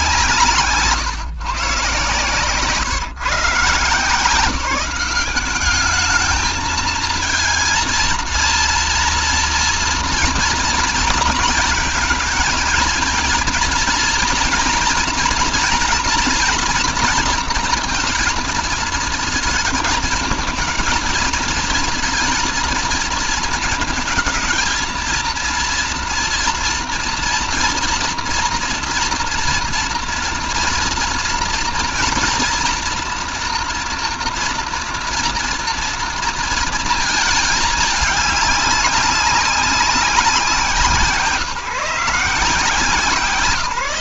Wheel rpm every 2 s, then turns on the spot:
170, 140, 170, 220, 230, 230, 230, 230, 240, 230, 220, 230, 220, 230, 230, 230, 240, 230, 230, 200, 160, 150.
none